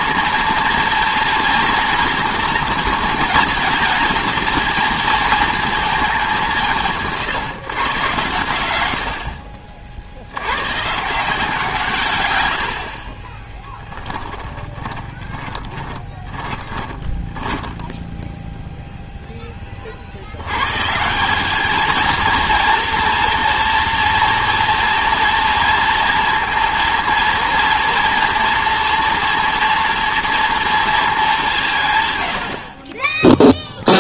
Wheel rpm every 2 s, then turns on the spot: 230, 230, 220, 170, 110, 110, 80, 20, 20, 0, 120, 230, 230, 230, 230, 230, 60.
14-18